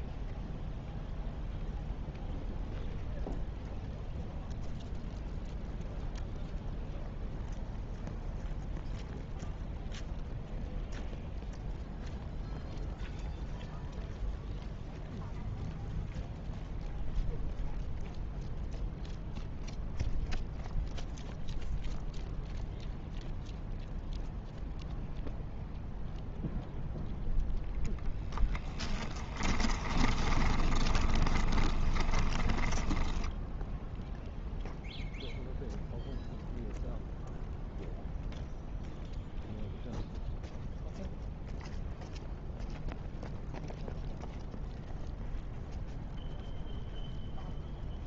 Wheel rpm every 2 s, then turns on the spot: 0, 0, 0, 0, 0, 0, 0, 0, 0, 0, 0, 0, 0, 0, 10, 20, 10, 0, 0, 0, 0, 0, 0, 0.
28-34